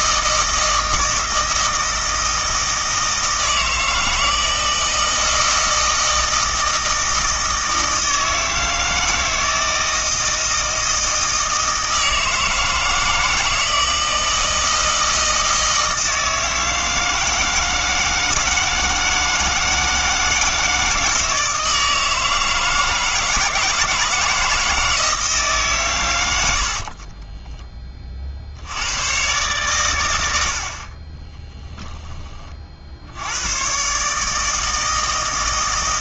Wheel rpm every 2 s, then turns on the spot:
160, 160, 160, 160, 160, 160, 160, 160, 160, 160, 160, 160, 160, 60, 90, 60, 60, 160.
26-28